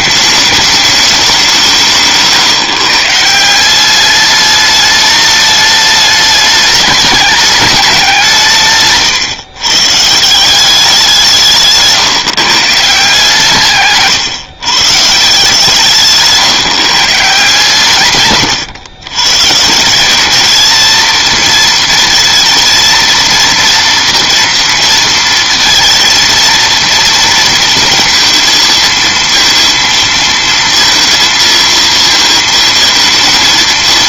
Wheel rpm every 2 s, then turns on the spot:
210, 150, 210, 210, 150, 190, 150, 140, 140, 110, 220, 230, 230, 230, 230, 230, 220.
none